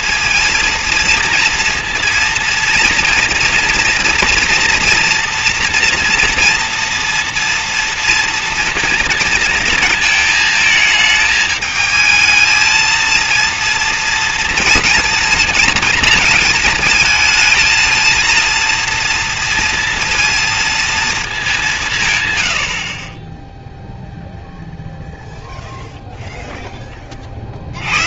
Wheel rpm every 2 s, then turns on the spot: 230, 230, 240, 230, 230, 220, 230, 230, 220, 230, 230, 60, 0, 0.
none